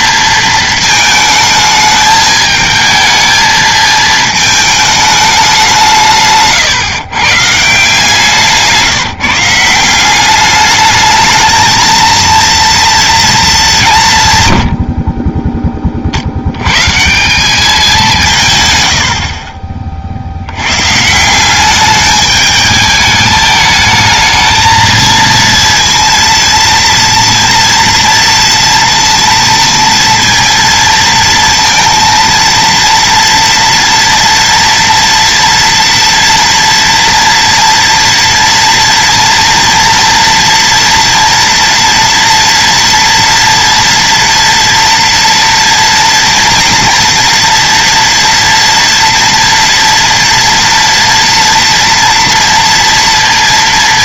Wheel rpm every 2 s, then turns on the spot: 220, 220, 220, 140, 160, 210, 230, 80, 120, 120, 110, 210, 220, 230, 230, 230, 230, 230, 230, 230, 230, 230, 230, 230, 230, 230, 230.
none